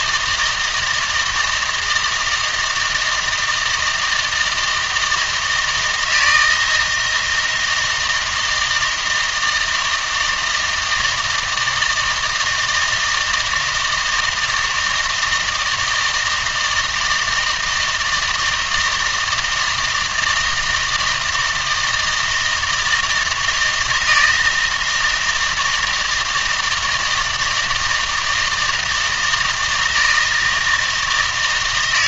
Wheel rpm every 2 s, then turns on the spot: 160, 160, 160, 160, 160, 160, 160, 160, 160, 160, 160, 170, 160, 160, 160, 160.
none